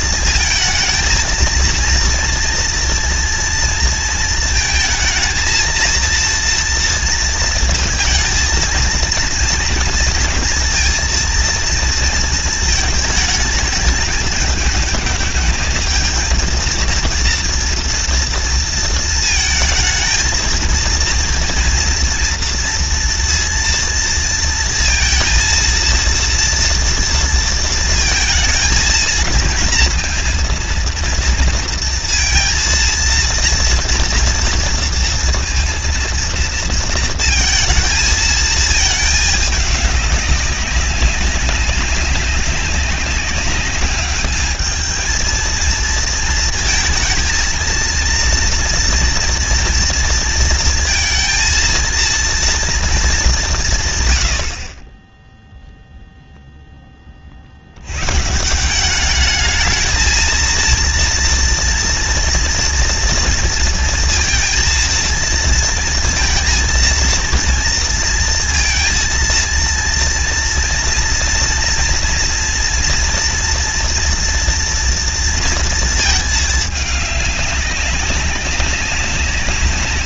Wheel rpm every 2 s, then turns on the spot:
230, 230, 230, 230, 230, 230, 220, 210, 230, 230, 220, 230, 230, 230, 230, 230, 230, 230, 230, 220, 200, 200, 210, 230, 230, 230, 230, 60, 10, 180, 230, 230, 230, 230, 230, 230, 240, 230, 210, 190.
none